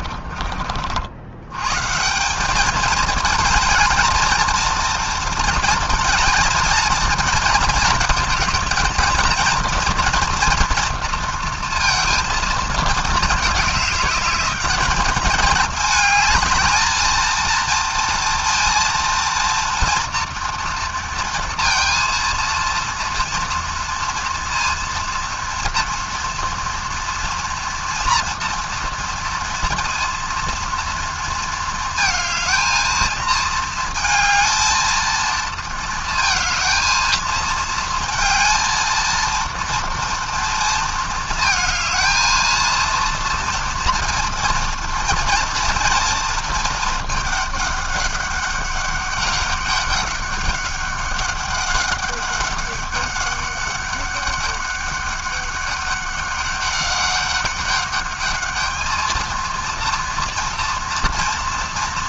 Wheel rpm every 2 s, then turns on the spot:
50, 200, 220, 220, 220, 230, 230, 210, 220, 230, 230, 230, 230, 230, 230, 230, 220, 220, 220, 220, 230, 230, 230, 220, 200, 200, 200, 200, 200, 210, 230.
none